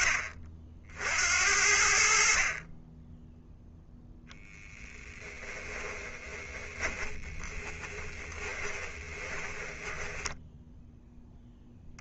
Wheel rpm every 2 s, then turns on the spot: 70, 10, 10, 20, 20, 0.
4-10